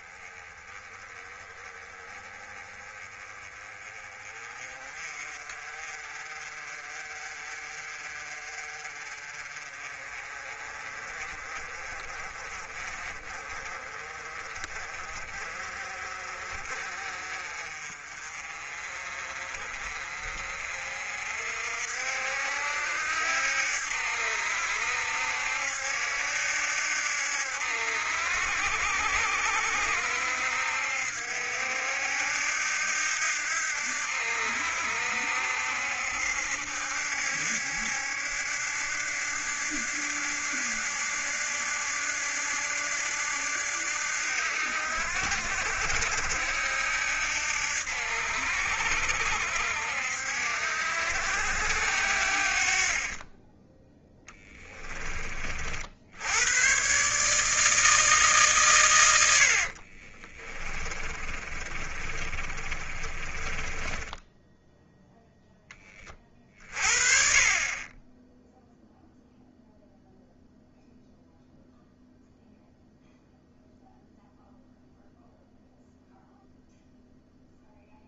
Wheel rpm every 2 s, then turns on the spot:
20, 20, 30, 40, 40, 30, 30, 30, 40, 40, 50, 70, 70, 70, 70, 70, 80, 70, 70, 70, 80, 80, 70, 70, 70, 70, 40, 20, 130, 120, 30, 30, 0, 40, 0, 0, 0, 0, 0.
54-56 60-64